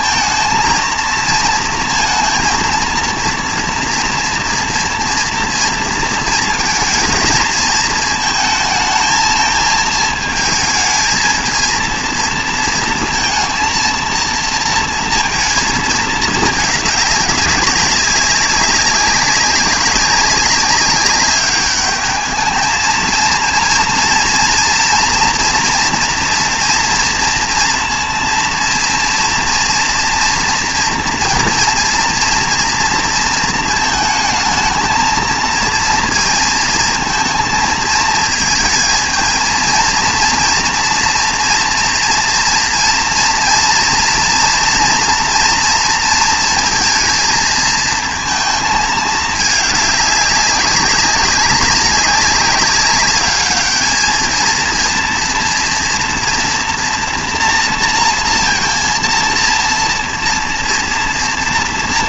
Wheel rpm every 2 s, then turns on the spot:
230, 230, 230, 220, 220, 220, 230, 230, 210, 200, 200, 220, 240, 230, 230, 240, 230, 220, 230, 220, 230, 230, 230, 230, 220, 200, 200, 230, 240, 230, 230.
none